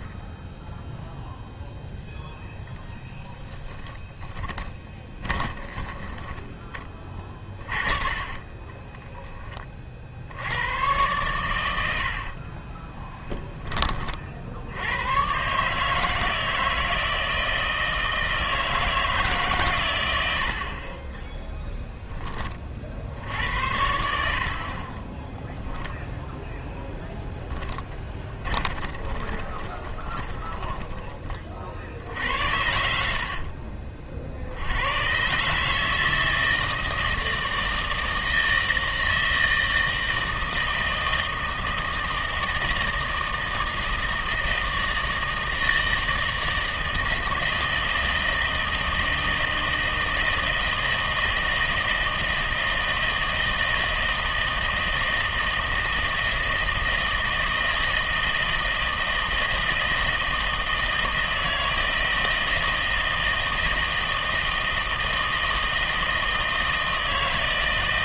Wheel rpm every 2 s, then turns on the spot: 0, 0, 20, 20, 20, 100, 20, 100, 160, 160, 40, 60, 30, 10, 20, 10, 70, 100, 160, 160, 160, 160, 160, 160, 160, 160, 160, 160, 160, 160, 160, 160, 160, 160.
4-10 12-14 24-26 28-32